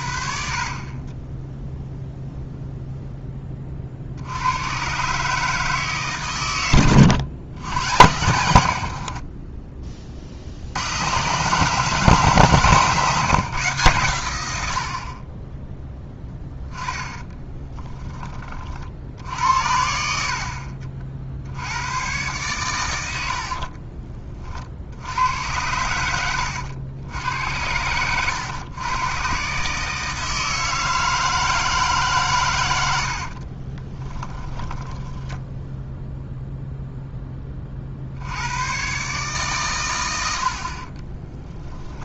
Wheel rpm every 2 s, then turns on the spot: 40, 0, 130, 100, 60, 100, 150, 70, 10, 50, 50, 100, 70, 90, 120, 160, 80, 10, 0, 130, 40.
8-10 16-18 34-36 40-42